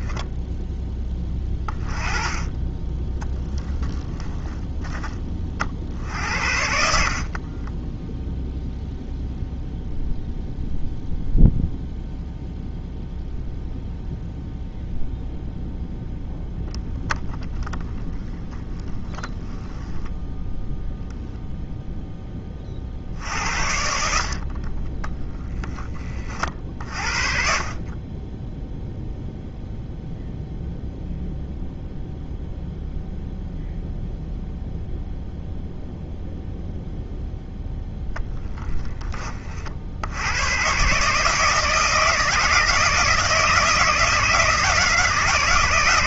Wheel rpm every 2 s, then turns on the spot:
10, 10, 20, 60, 0, 0, 0, 0, 10, 10, 0, 50, 10, 50, 0, 0, 0, 0, 0, 20, 140, 160, 160.
6-8